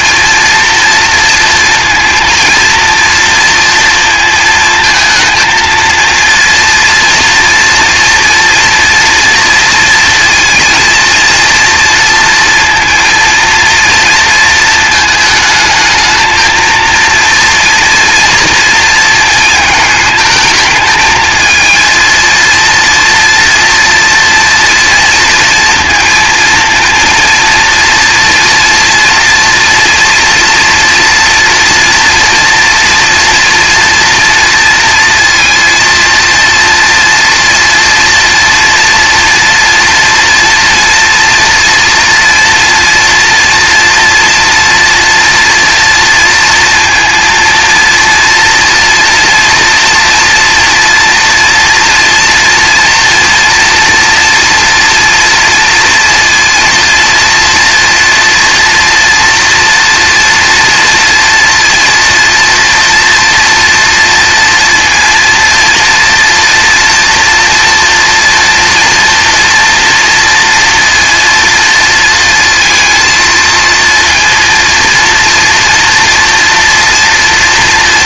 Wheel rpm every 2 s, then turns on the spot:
230, 230, 230, 230, 230, 230, 230, 220, 230, 230, 220, 230, 230, 230, 230, 240, 230, 230, 230, 230, 230, 240, 230, 230, 240, 230, 230, 230, 230, 230, 230, 230, 230, 240, 230, 230, 230, 230, 240.
none